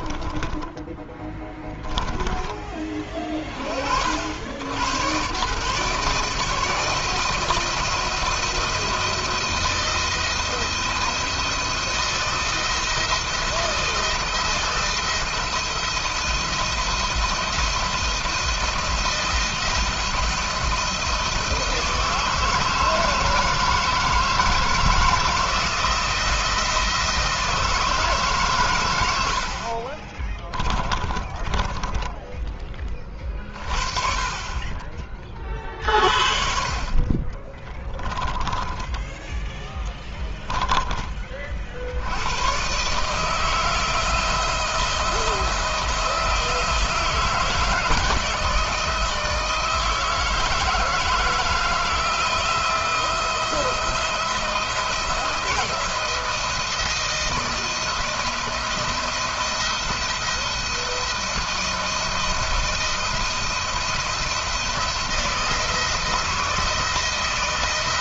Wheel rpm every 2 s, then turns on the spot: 20, 20, 90, 160, 170, 170, 160, 170, 170, 170, 170, 160, 160, 170, 130, 30, 20, 30, 40, 20, 20, 130, 160, 160, 160, 160, 170, 160, 170, 170, 170, 160, 170, 160.
0-2 30-32 38-40